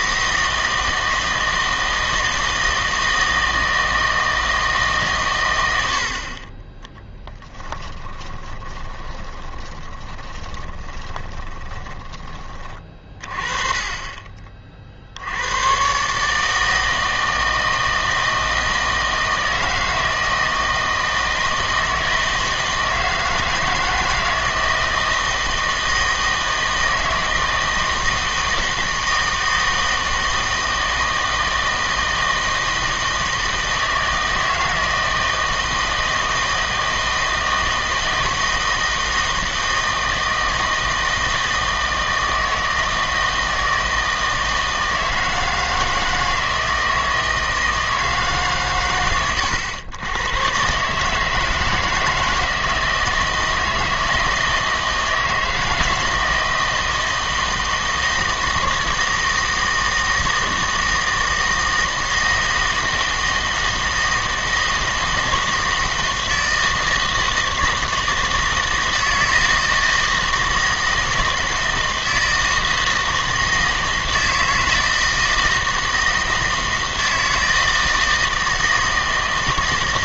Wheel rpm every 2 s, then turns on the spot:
160, 160, 160, 20, 20, 20, 30, 40, 160, 160, 160, 160, 160, 160, 160, 160, 160, 160, 160, 160, 160, 160, 160, 160, 130, 130, 160, 160, 160, 160, 160, 160, 160, 160, 160, 160, 160, 160, 160, 160.
8-12